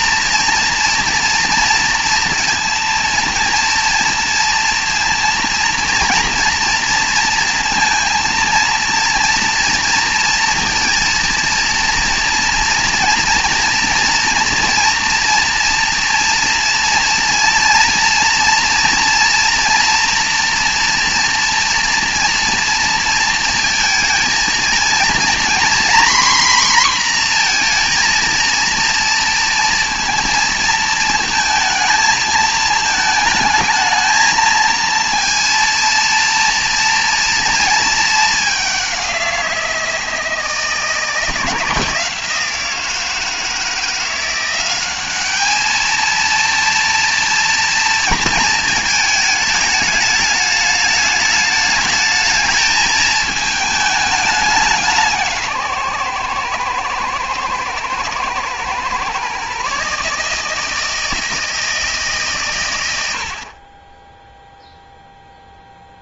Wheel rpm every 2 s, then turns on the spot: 240, 230, 230, 230, 230, 230, 230, 230, 230, 230, 240, 230, 220, 250, 230, 230, 220, 220, 230, 200, 160, 170, 190, 230, 220, 210, 220, 180, 120, 120, 160, 120, 0.
none